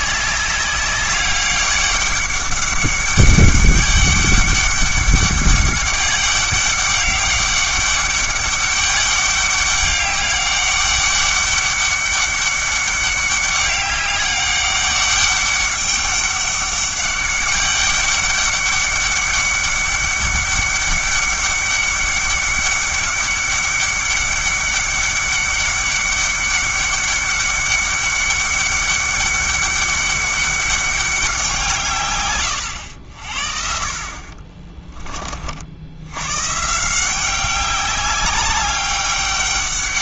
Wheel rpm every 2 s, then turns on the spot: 200, 200, 200, 200, 200, 200, 200, 200, 200, 200, 200, 200, 200, 200, 200, 200, 90, 30, 150, 200.
none